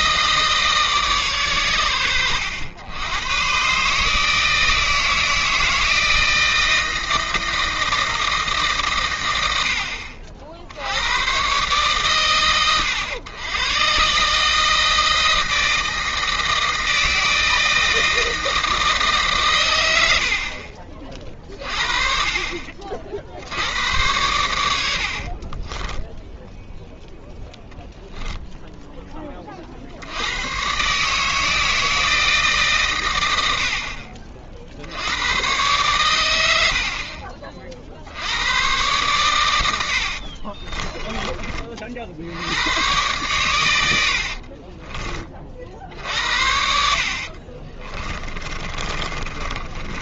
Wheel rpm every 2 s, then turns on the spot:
150, 100, 160, 160, 140, 60, 100, 160, 160, 160, 40, 40, 80, 0, 10, 120, 140, 70, 60, 110, 30, 100, 30, 70, 30.
36-38 40-42 44-46 48-50